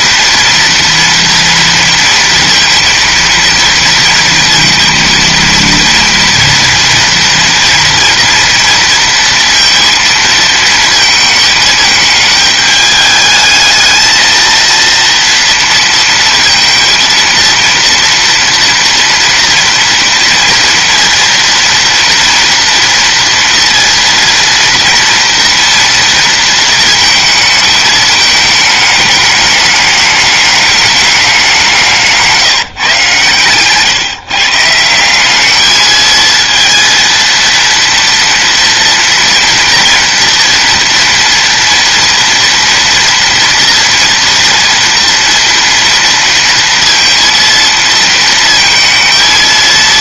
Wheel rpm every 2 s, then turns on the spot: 230, 230, 230, 230, 230, 230, 210, 230, 230, 230, 230, 230, 230, 230, 220, 210, 150, 160, 220, 230, 230, 230, 240, 230, 230.
none